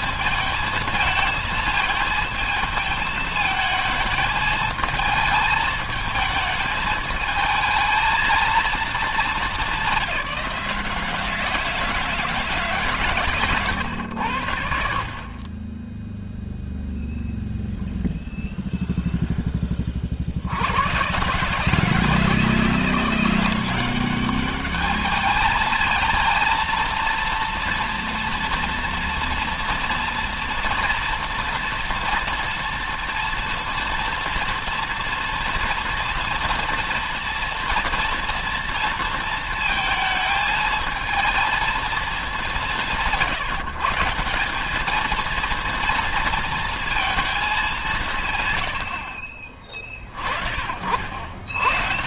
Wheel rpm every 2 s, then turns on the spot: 220, 220, 220, 220, 220, 170, 150, 70, 0, 0, 90, 170, 210, 230, 240, 230, 230, 230, 230, 230, 220, 180, 200, 230, 130, 40.
none